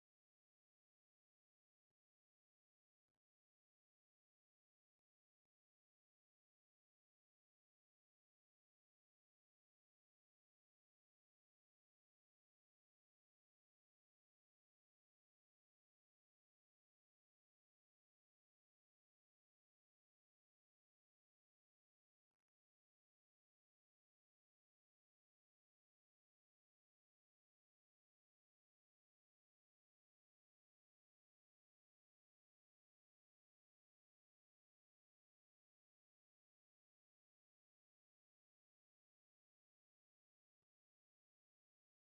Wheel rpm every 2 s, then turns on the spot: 0, 0, 0, 0, 0, 0, 0, 0, 0, 0, 0, 0, 0, 0, 0, 0, 0, 0, 0, 0, 0.
none